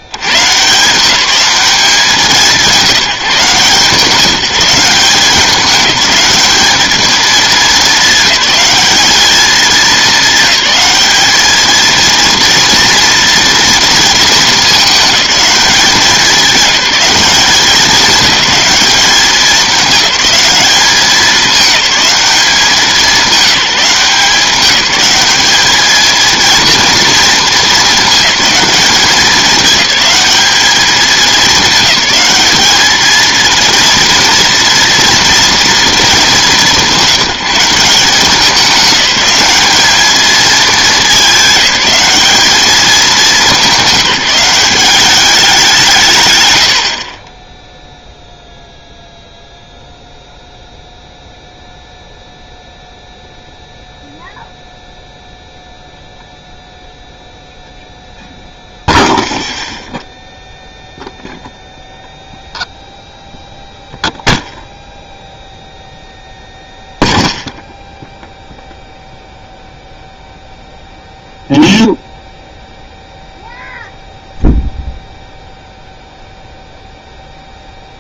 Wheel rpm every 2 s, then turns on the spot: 140, 170, 180, 220, 200, 210, 230, 210, 200, 200, 210, 190, 180, 230, 210, 210, 210, 230, 200, 190, 220, 210, 180, 100, 0, 0, 0, 0, 0, 0, 0, 0, 0, 0, 0, 0, 0, 0, 0.
none